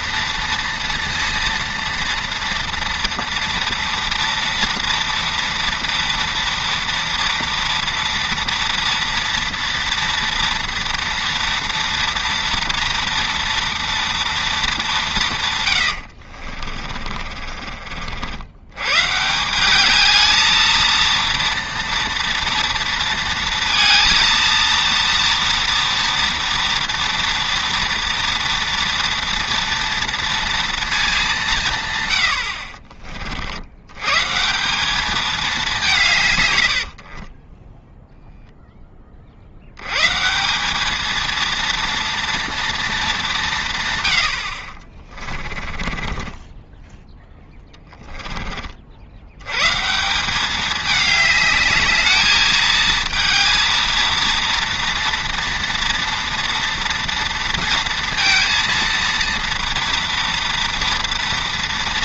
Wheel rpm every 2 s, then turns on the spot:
230, 230, 230, 230, 230, 240, 230, 220, 50, 100, 220, 230, 230, 230, 230, 230, 60, 180, 100, 0, 190, 230, 50, 20, 40, 210, 220, 230, 230, 230, 230.
16-18 36-38 44-48